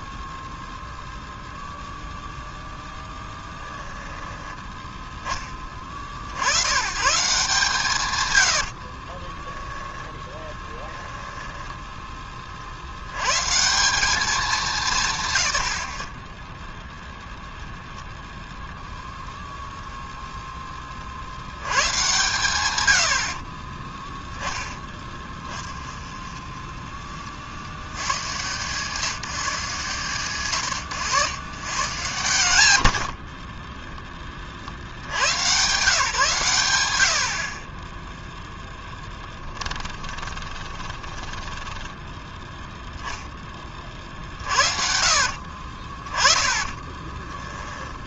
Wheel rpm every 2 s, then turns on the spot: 0, 0, 20, 110, 50, 20, 80, 170, 0, 0, 20, 110, 10, 30, 150, 110, 90, 60, 90, 10, 20, 10, 50, 20.
8-12 24-26 32-34 38-42 46-48